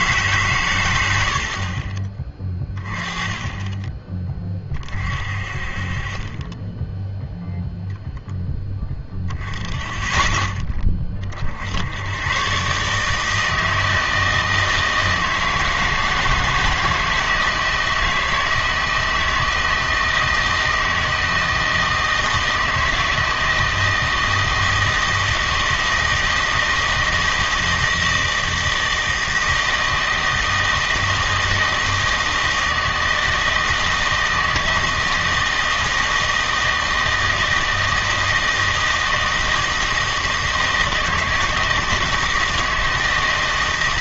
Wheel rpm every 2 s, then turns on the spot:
110, 20, 30, 10, 10, 20, 140, 160, 160, 160, 160, 160, 160, 160, 160, 160, 160, 160, 160, 160, 160, 160.
2-4